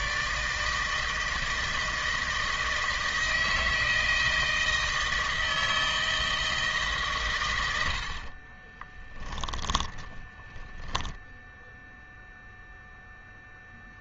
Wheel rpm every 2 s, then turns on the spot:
160, 160, 160, 150, 30, 10, 0.
8-12